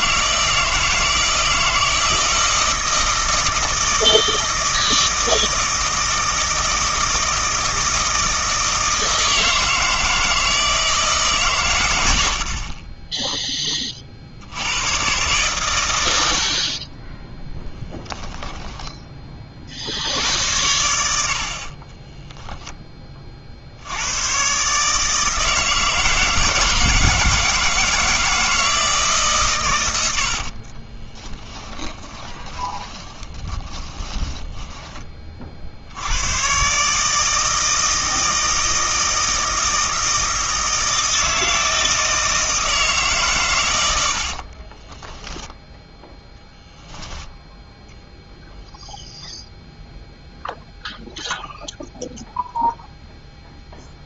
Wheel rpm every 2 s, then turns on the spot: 160, 160, 160, 160, 160, 160, 40, 100, 40, 10, 90, 10, 140, 160, 160, 40, 20, 10, 130, 160, 160, 160, 30, 0, 0, 0, 0.
18-20 30-34 44-46